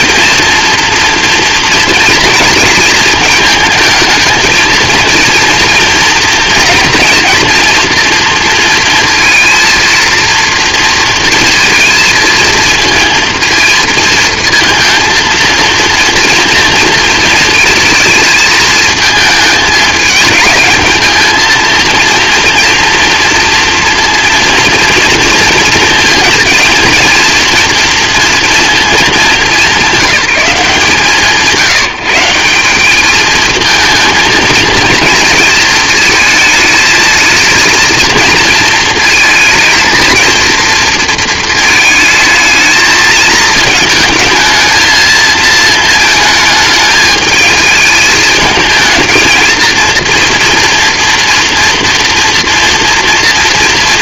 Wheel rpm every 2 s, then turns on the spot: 230, 220, 230, 230, 230, 230, 230, 230, 230, 220, 210, 230, 230, 230, 230, 160, 200, 220, 220, 230, 230, 220, 220, 220, 220, 240, 230.
none